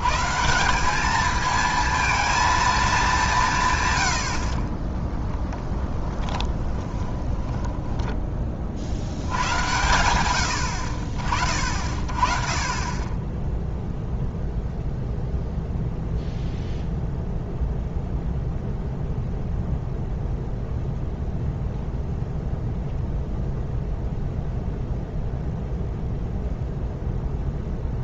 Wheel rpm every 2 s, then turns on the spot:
190, 220, 30, 20, 50, 70, 20, 0, 0, 0, 0, 0, 0, 0.
6-8